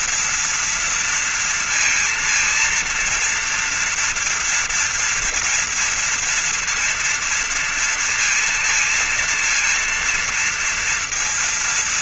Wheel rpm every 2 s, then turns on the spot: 240, 230, 230, 240, 230, 230.
none